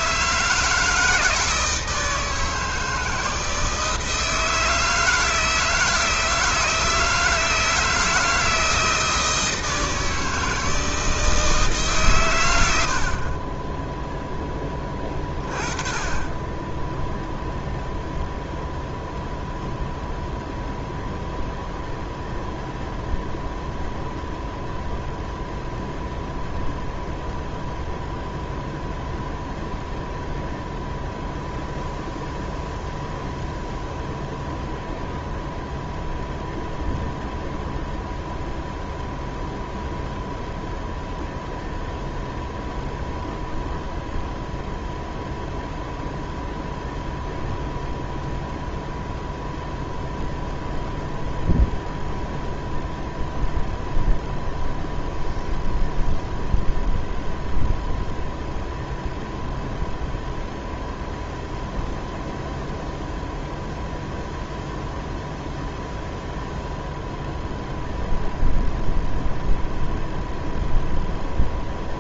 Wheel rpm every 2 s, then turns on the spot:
160, 160, 160, 160, 160, 160, 80, 20, 10, 0, 0, 0, 0, 0, 0, 0, 0, 0, 0, 0, 0, 0, 0, 0, 0, 0, 0, 0, 0, 0, 0, 0, 0, 0, 0, 0.
none